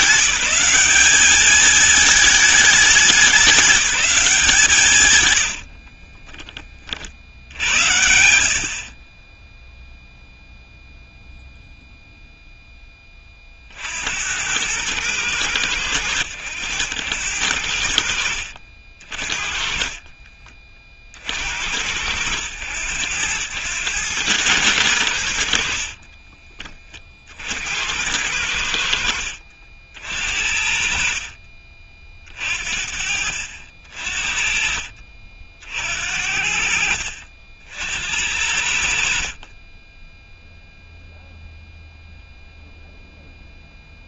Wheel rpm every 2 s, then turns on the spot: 200, 220, 170, 20, 60, 0, 0, 90, 90, 60, 30, 90, 100, 20, 90, 60, 50, 50, 60, 70, 0, 0.
none